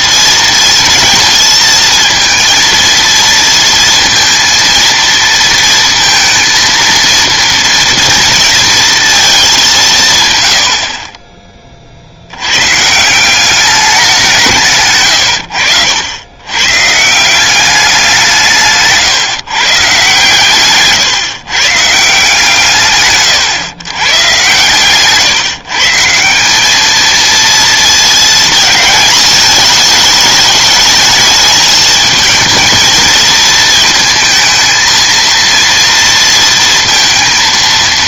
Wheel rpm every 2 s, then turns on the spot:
230, 230, 230, 230, 230, 60, 120, 150, 110, 160, 130, 140, 120, 190, 220, 210, 220, 220, 230.
none